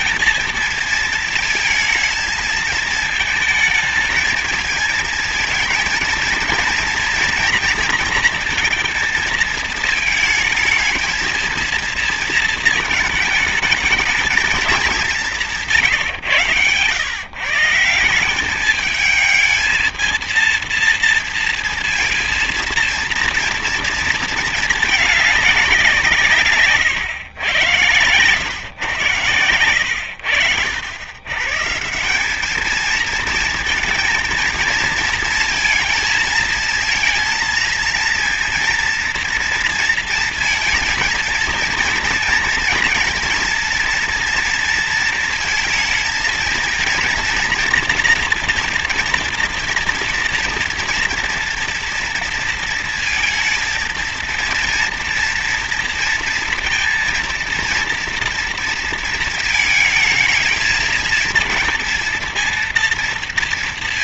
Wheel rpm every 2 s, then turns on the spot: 230, 220, 220, 230, 230, 230, 220, 210, 120, 210, 230, 230, 220, 130, 120, 90, 220, 230, 230, 230, 230, 230, 230, 230, 240, 230, 230, 230, 230, 230, 220, 230.
none